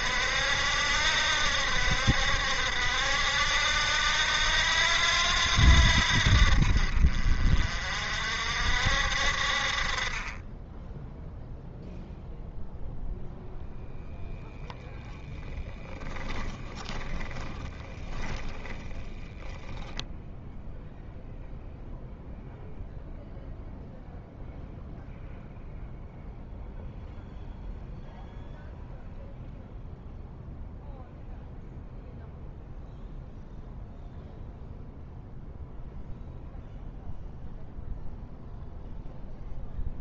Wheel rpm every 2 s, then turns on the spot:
70, 70, 80, 50, 60, 10, 0, 0, 20, 20, 0, 0, 0, 0, 0, 0, 0, 0, 0, 0.
16-20